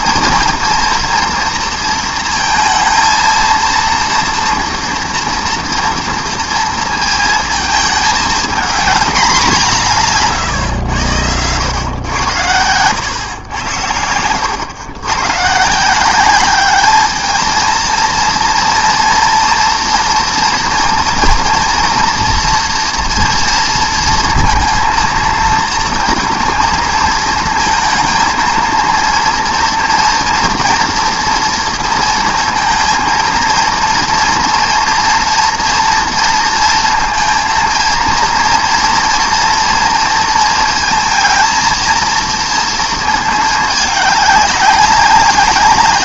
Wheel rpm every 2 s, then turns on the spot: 230, 230, 230, 230, 220, 120, 100, 110, 210, 230, 230, 240, 230, 230, 230, 230, 230, 230, 230, 230, 230, 230, 200.
none